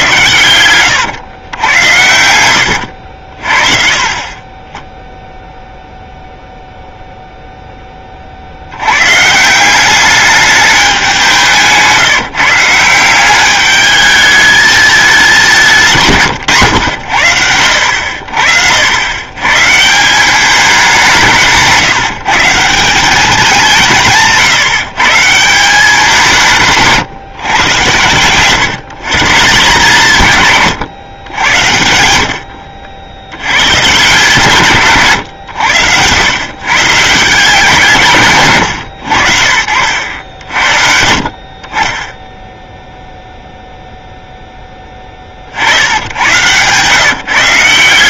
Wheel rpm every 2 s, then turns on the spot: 100, 80, 20, 0, 80, 200, 160, 210, 120, 80, 190, 170, 170, 160, 130, 120, 70, 140, 120, 140, 60, 0, 10, 120.
0-4